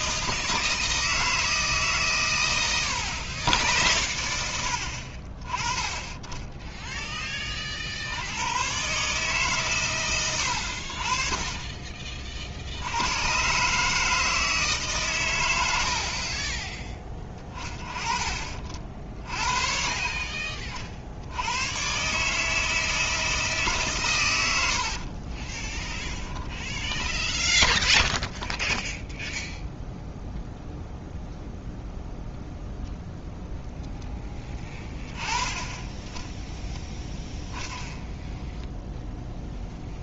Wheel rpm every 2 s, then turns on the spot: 160, 100, 70, 10, 120, 80, 70, 150, 20, 40, 40, 160, 90, 10, 0, 0, 0, 10, 0, 0.
26-28